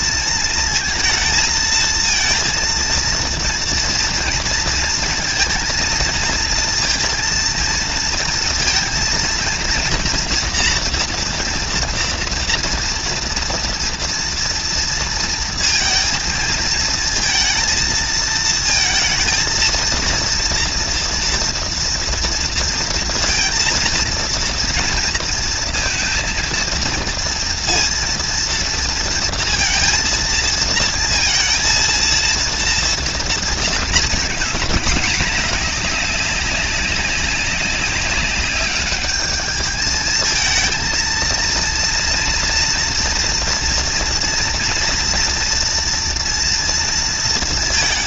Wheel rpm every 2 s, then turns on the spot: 230, 230, 230, 230, 230, 230, 230, 230, 220, 230, 230, 230, 230, 230, 230, 230, 230, 220, 200, 200, 220, 230, 240, 230.
none